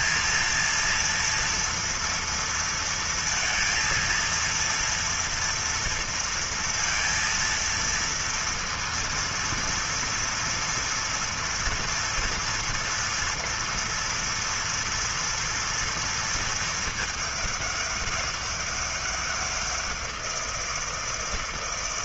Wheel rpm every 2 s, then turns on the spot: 230, 230, 230, 230, 230, 230, 230, 230, 230, 200, 170.
none